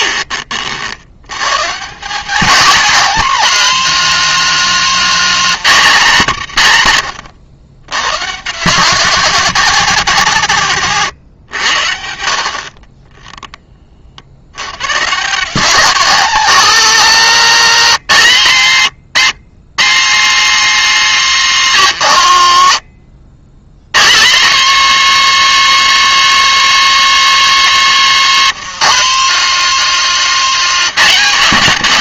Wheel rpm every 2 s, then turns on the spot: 50, 220, 230, 150, 160, 150, 40, 110, 220, 150, 220, 90, 180, 220, 180, 180.
none